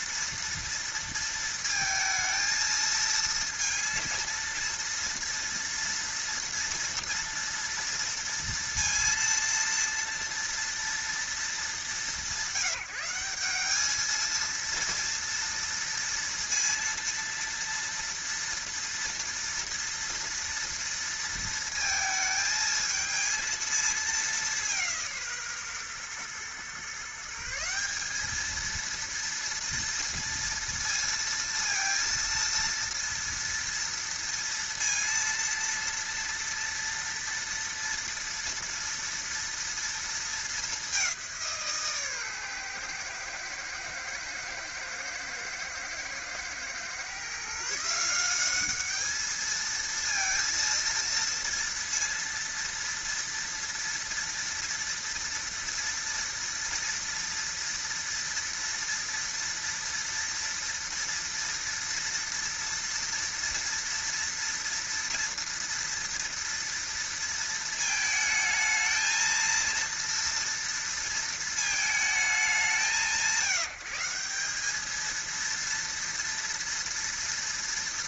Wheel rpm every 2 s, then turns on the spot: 230, 230, 230, 230, 230, 230, 180, 230, 230, 230, 230, 220, 170, 140, 230, 230, 230, 230, 230, 230, 200, 120, 110, 120, 210, 230, 230, 230, 240, 230, 230, 230, 230, 230, 220, 230, 150, 220, 230.
none